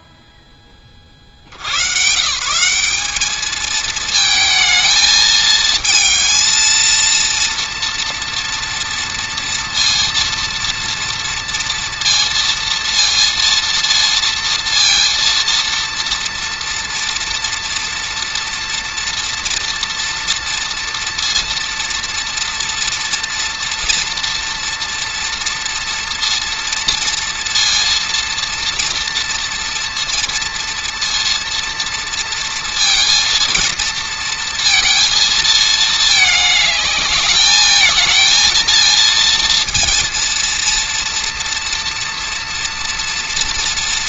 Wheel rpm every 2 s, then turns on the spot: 0, 150, 220, 220, 230, 230, 230, 230, 230, 240, 230, 230, 230, 230, 230, 230, 230, 230, 210, 230, 230, 230.
none